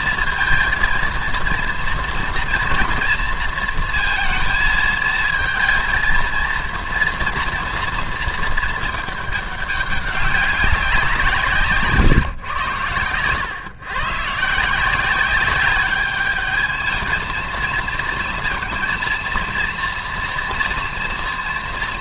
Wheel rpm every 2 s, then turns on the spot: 230, 230, 220, 230, 220, 190, 120, 170, 220, 230, 230.
none